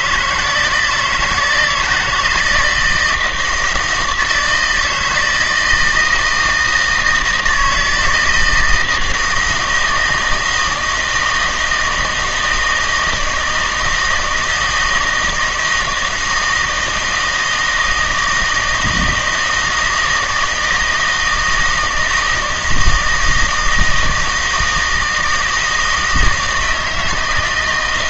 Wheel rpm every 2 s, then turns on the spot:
160, 170, 160, 160, 160, 160, 160, 160, 160, 160, 160, 160, 160, 160.
none